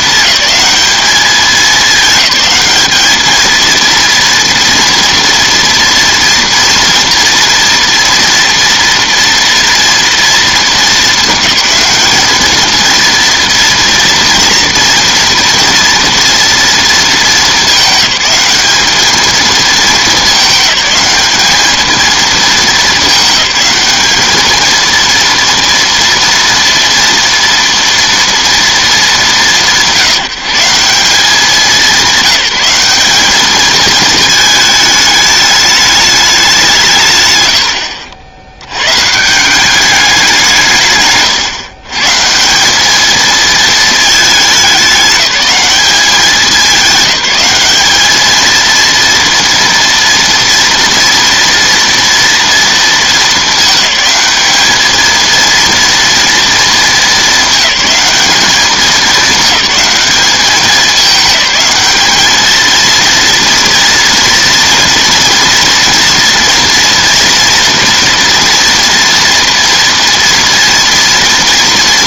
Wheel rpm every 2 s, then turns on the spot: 200, 210, 230, 230, 230, 220, 220, 230, 220, 200, 210, 210, 220, 240, 220, 190, 200, 220, 170, 110, 150, 200, 200, 200, 230, 230, 230, 220, 210, 200, 210, 230, 230, 230, 230, 230.
none